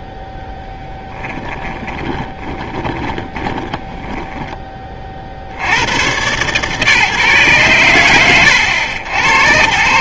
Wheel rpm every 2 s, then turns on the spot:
0, 20, 20, 140, 90.
2-4